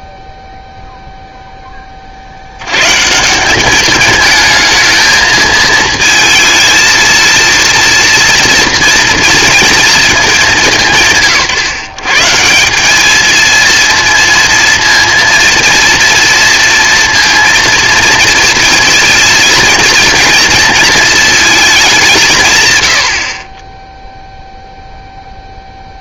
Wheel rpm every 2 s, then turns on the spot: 0, 90, 220, 230, 240, 190, 180, 230, 230, 230, 230, 140, 0.
none